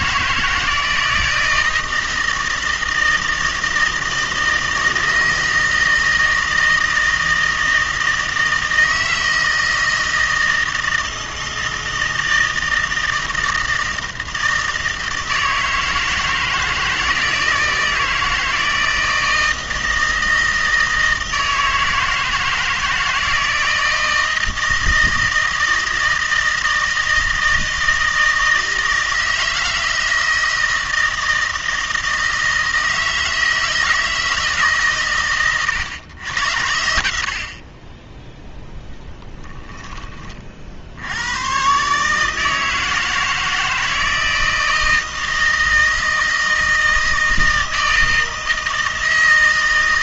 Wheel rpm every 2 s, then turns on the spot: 160, 160, 160, 160, 160, 160, 160, 160, 160, 160, 160, 160, 160, 160, 160, 160, 160, 110, 50, 10, 110, 160, 160, 160, 160.
none